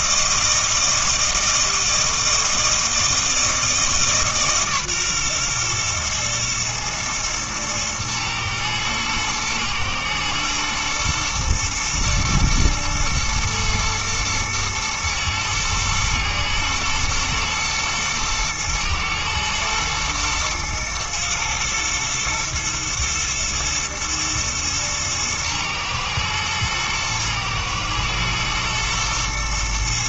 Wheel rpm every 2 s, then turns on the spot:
160, 160, 140, 120, 110, 110, 110, 110, 120, 110, 120, 110, 110, 110, 120.
none